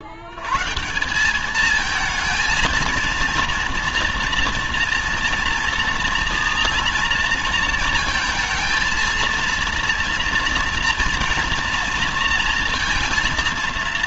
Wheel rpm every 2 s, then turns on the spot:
170, 230, 230, 230, 230, 230, 230.
none